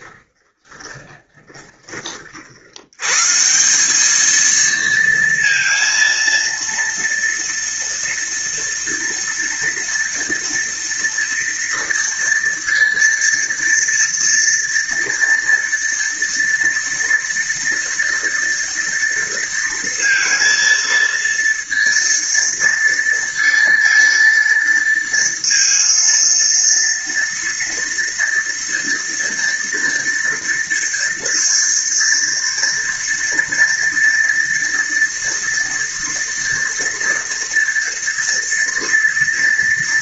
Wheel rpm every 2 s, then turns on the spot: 20, 50, 220, 230, 230, 230, 230, 230, 230, 230, 230, 230, 230, 230, 240, 230, 240, 230, 230, 230.
0-2